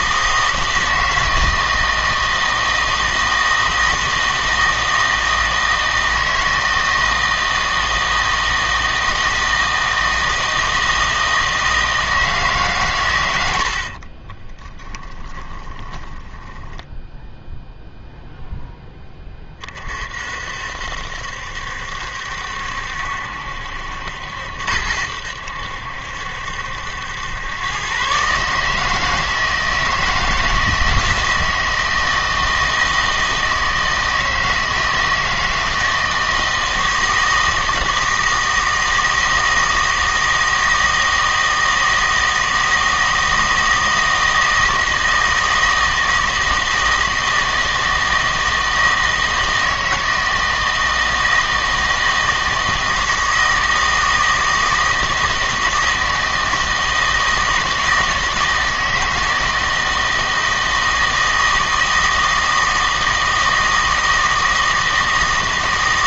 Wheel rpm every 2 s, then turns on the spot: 160, 160, 160, 160, 160, 160, 130, 10, 10, 0, 60, 70, 80, 70, 150, 160, 160, 160, 160, 160, 160, 160, 160, 160, 160, 160, 160, 160, 160, 160, 160, 160, 160.
14-18